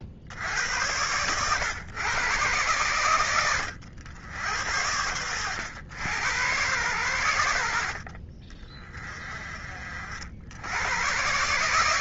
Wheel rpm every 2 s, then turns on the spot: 100, 120, 90, 110, 40, 70.
none